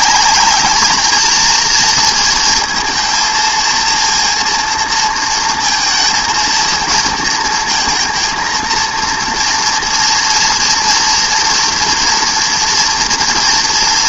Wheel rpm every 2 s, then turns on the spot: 220, 230, 230, 230, 230, 230, 230.
none